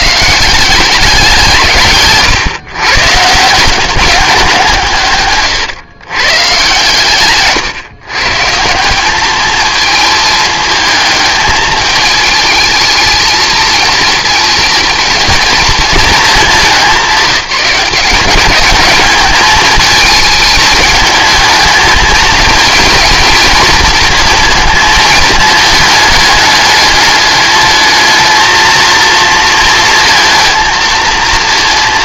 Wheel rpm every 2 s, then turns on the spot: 180, 130, 180, 130, 150, 220, 220, 230, 200, 200, 220, 220, 230, 210, 230, 220.
none